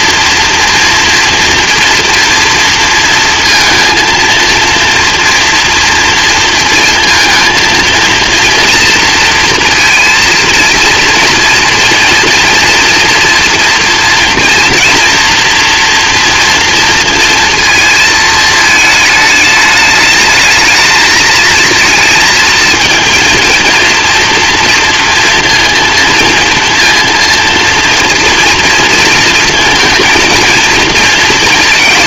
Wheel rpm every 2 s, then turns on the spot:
230, 230, 230, 230, 230, 230, 230, 230, 230, 220, 220, 220, 230, 230, 230, 230.
none